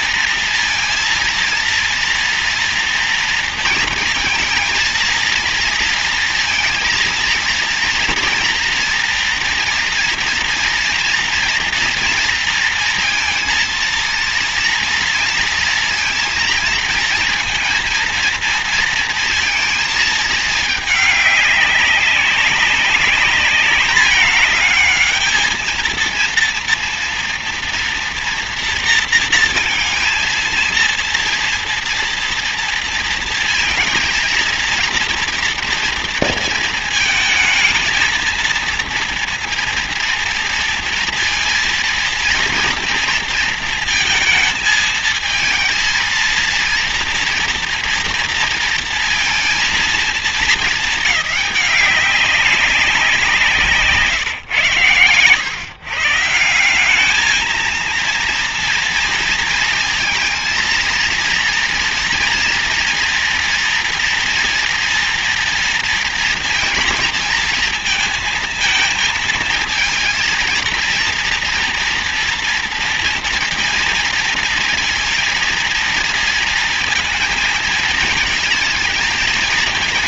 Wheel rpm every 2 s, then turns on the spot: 230, 230, 230, 230, 230, 230, 230, 230, 230, 230, 220, 200, 210, 230, 230, 230, 230, 230, 220, 230, 230, 230, 220, 230, 230, 230, 190, 130, 170, 230, 230, 230, 230, 230, 230, 230, 230, 230, 230, 220.
none